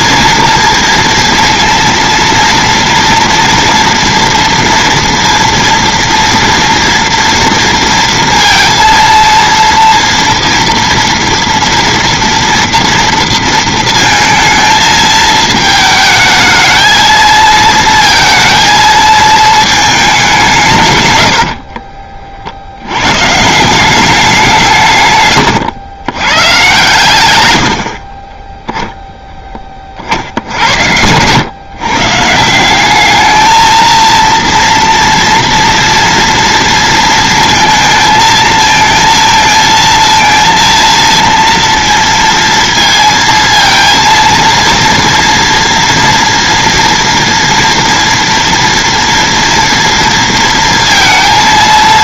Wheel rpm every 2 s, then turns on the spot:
230, 230, 230, 230, 230, 230, 230, 220, 220, 230, 150, 90, 150, 130, 10, 70, 170, 230, 230, 220, 230, 230, 230, 230, 230, 230.
none